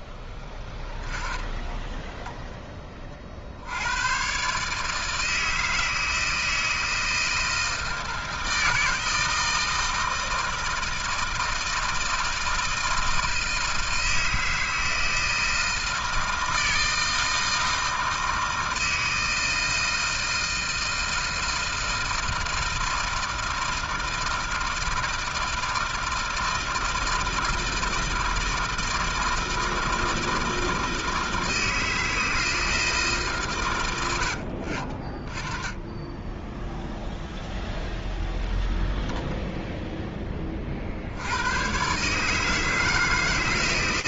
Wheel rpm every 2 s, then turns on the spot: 20, 30, 150, 160, 160, 160, 160, 160, 160, 160, 160, 160, 160, 160, 160, 160, 160, 40, 0, 0, 40, 160.
none